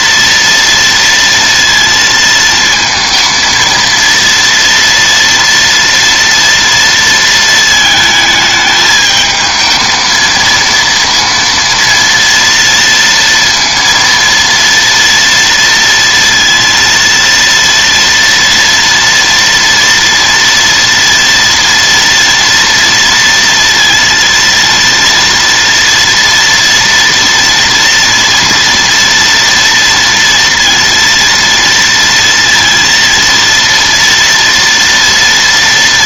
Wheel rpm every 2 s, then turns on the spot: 230, 230, 230, 230, 220, 230, 230, 230, 230, 230, 230, 230, 230, 230, 230, 230, 230, 230.
none